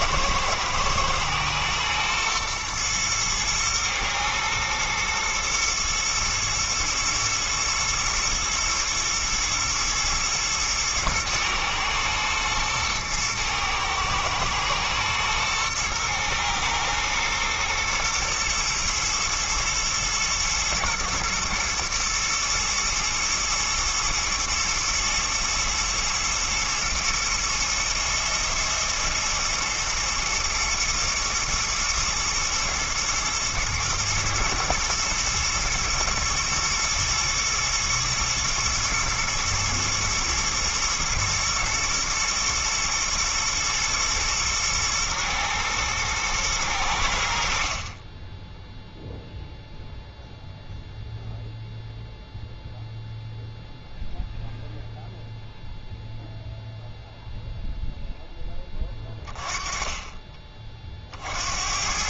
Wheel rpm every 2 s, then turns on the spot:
120, 120, 110, 120, 120, 110, 110, 120, 120, 120, 120, 110, 110, 110, 110, 110, 120, 110, 120, 110, 110, 110, 110, 90, 0, 0, 0, 0, 0, 30, 50.
none